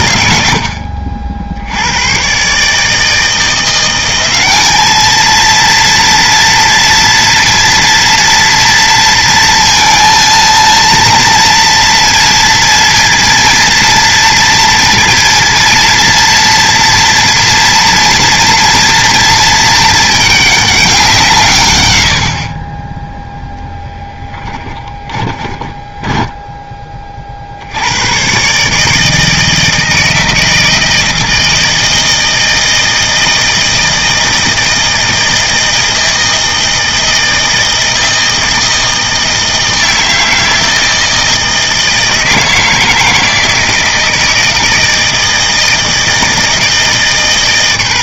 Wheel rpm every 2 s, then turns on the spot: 70, 140, 200, 230, 230, 230, 230, 230, 230, 230, 200, 30, 20, 10, 140, 160, 160, 160, 160, 160, 160, 160, 160, 160.
24-26